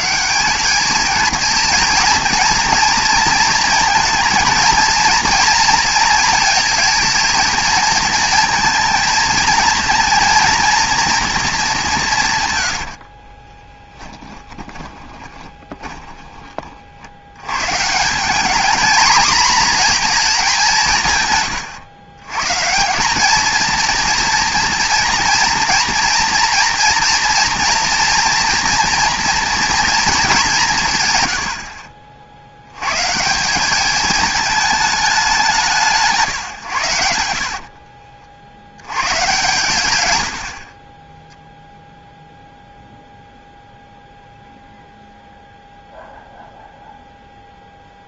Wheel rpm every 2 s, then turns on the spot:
210, 230, 230, 230, 230, 230, 100, 20, 40, 220, 200, 160, 230, 240, 230, 170, 110, 220, 100, 90, 40, 0, 0, 0.
12-16